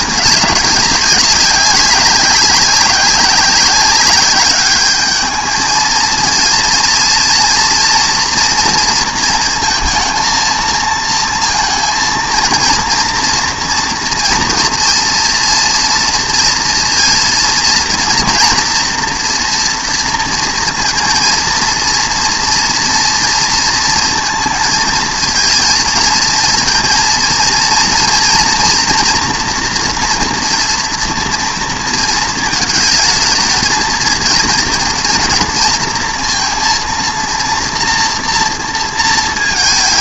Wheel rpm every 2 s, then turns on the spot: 200, 190, 200, 230, 230, 230, 230, 240, 230, 230, 230, 230, 220, 230, 240, 230, 220, 230, 230, 230.
none